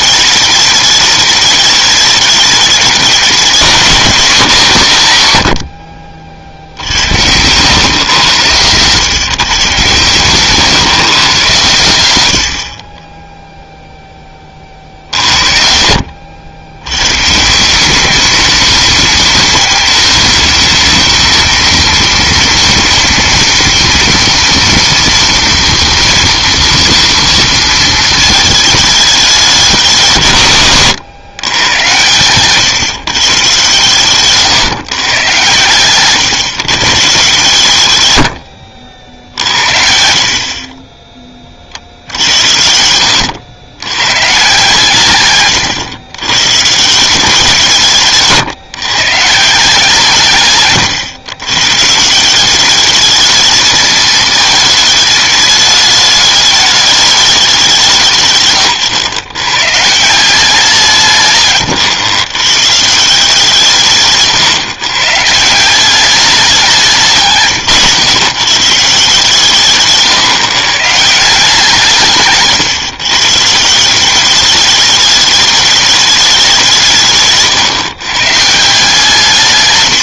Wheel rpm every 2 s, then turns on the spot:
210, 210, 140, 70, 130, 140, 30, 60, 110, 210, 220, 230, 230, 230, 210, 110, 140, 130, 130, 70, 10, 80, 140, 150, 140, 130, 210, 220, 210, 130, 160, 160, 130, 170, 150, 150, 130, 210, 170, 160.
42-44